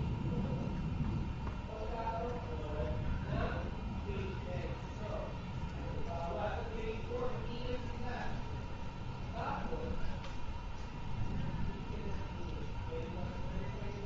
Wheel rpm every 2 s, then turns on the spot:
0, 0, 0, 0, 0, 0, 0.
none